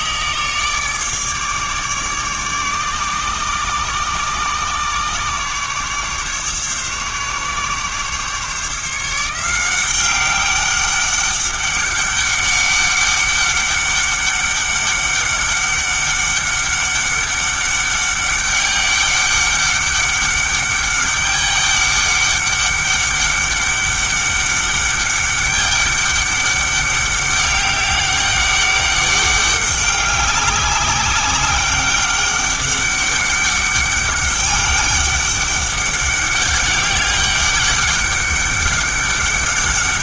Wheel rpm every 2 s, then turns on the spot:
150, 140, 140, 140, 160, 200, 200, 200, 200, 200, 200, 200, 200, 200, 200, 200, 200, 200, 200, 200.
none